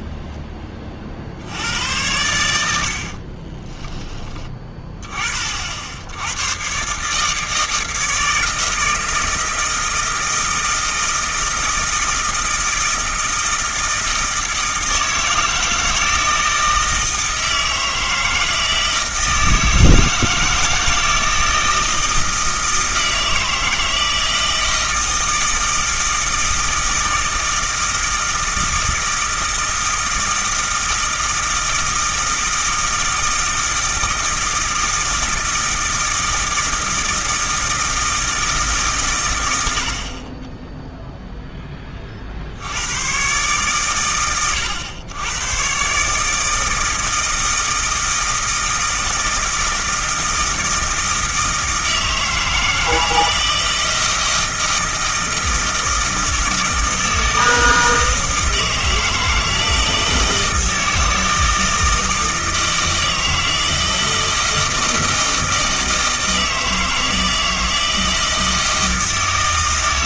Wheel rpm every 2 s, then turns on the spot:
30, 70, 20, 130, 160, 160, 160, 160, 160, 160, 160, 160, 160, 160, 160, 160, 160, 160, 160, 140, 0, 90, 110, 160, 160, 160, 160, 160, 160, 160, 160, 160, 160, 160, 160.
none